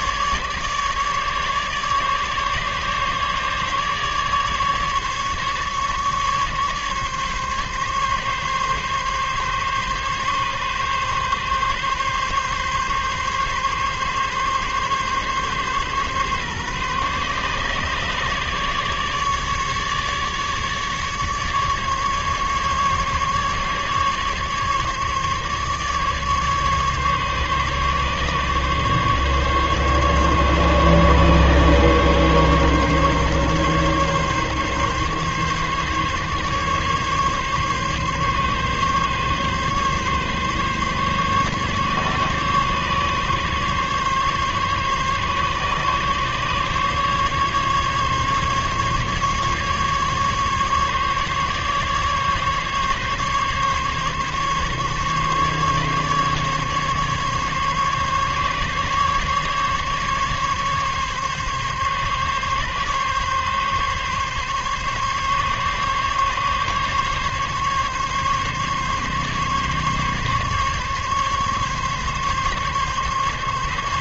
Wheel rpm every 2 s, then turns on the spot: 150, 150, 140, 140, 140, 140, 140, 140, 140, 150, 150, 140, 140, 150, 140, 140, 140, 140, 140, 140, 140, 140, 140, 140, 140, 140, 140, 140, 140, 140, 140, 140, 140, 140, 140, 140, 140.
none